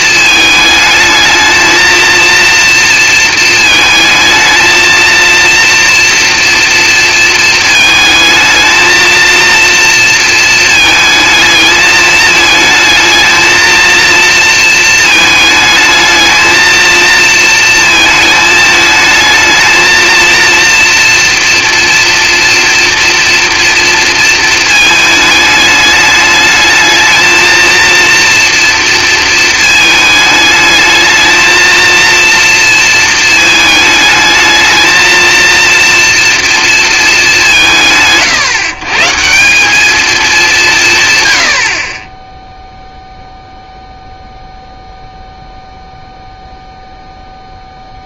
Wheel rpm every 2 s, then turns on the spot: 220, 230, 220, 230, 220, 220, 220, 230, 220, 220, 230, 230, 230, 210, 230, 210, 230, 220, 230, 150, 180, 0, 0, 0.
none